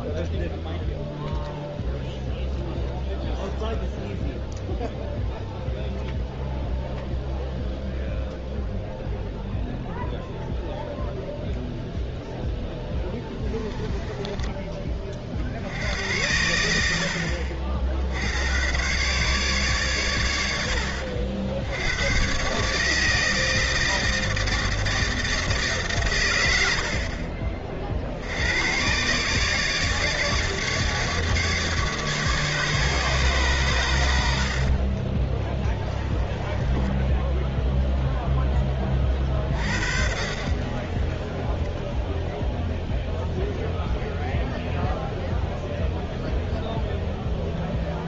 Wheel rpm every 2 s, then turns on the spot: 0, 0, 0, 0, 0, 0, 0, 20, 80, 110, 80, 140, 160, 100, 90, 150, 150, 50, 10, 10, 50, 0, 0, 0.
34-38